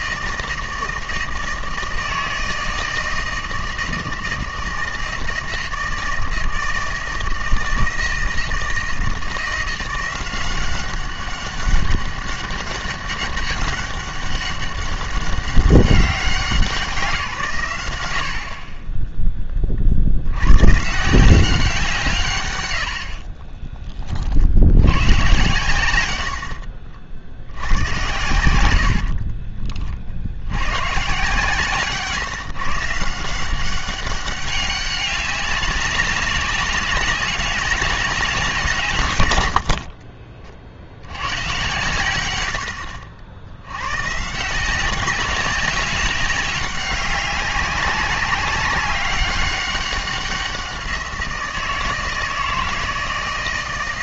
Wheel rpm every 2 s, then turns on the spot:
160, 160, 160, 160, 160, 190, 200, 200, 180, 40, 120, 110, 90, 70, 80, 100, 150, 190, 200, 170, 50, 90, 180, 200, 200, 180, 160.
26-28